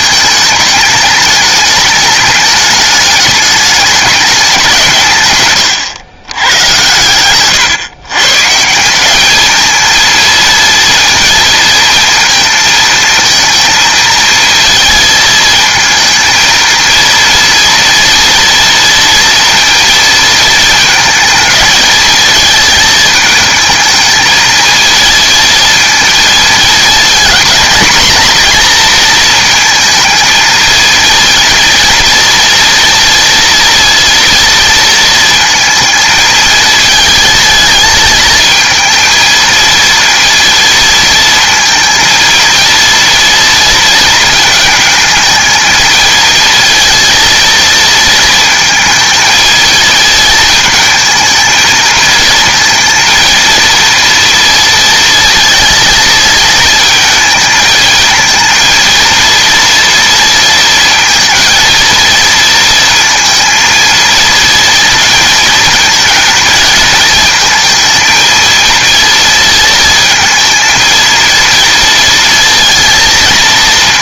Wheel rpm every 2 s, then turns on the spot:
210, 210, 190, 110, 150, 230, 230, 220, 230, 230, 230, 220, 220, 230, 240, 230, 230, 230, 220, 230, 230, 230, 220, 230, 220, 220, 220, 230, 220, 230, 230, 230, 230, 220, 230, 230, 230.
none